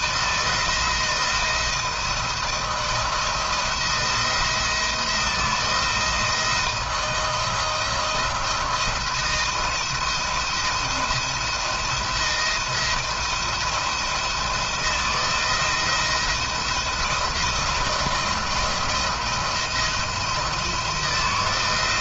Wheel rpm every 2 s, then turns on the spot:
160, 160, 160, 160, 170, 170, 170, 170, 170, 170, 160.
none